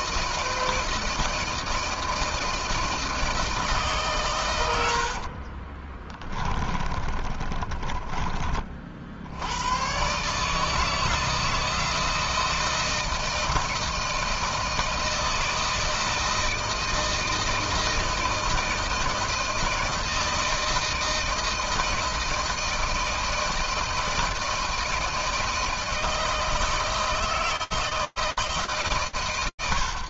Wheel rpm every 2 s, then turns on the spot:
160, 160, 100, 30, 30, 150, 160, 160, 160, 160, 160, 160, 160, 160, 130.
6-8